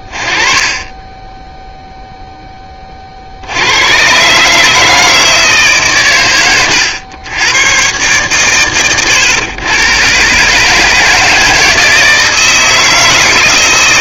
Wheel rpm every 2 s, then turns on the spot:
20, 0, 140, 120, 120, 150, 160.
none